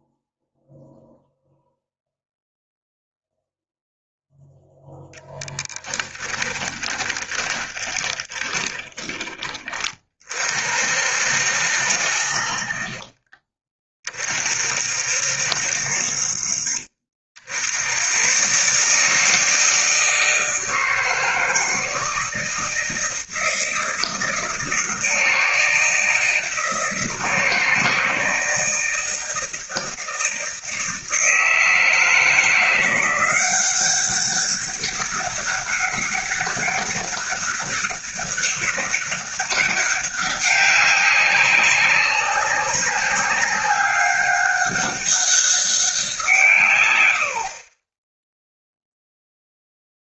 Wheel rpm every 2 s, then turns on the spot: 0, 0, 0, 20, 20, 50, 50, 60, 50, 150, 160, 160, 160, 160, 160, 160, 170, 200, 200, 200, 200, 200, 200, 110, 0.
6-10